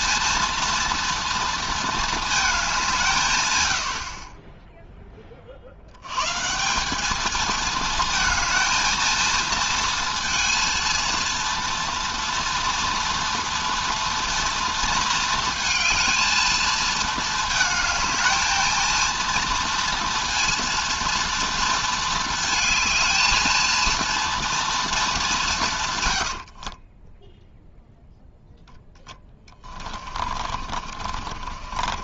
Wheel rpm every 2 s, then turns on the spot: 230, 200, 10, 170, 230, 230, 230, 230, 220, 220, 230, 220, 230, 50, 0, 40.
26-28 30-32